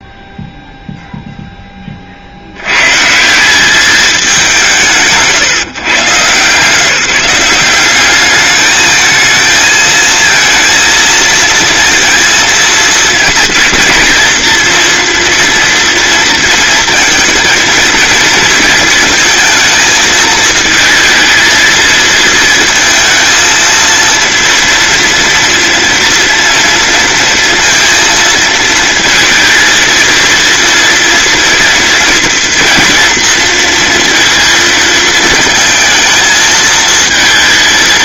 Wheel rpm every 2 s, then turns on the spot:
0, 160, 150, 170, 220, 230, 220, 230, 220, 230, 230, 230, 230, 230, 220, 230, 240, 220, 230.
none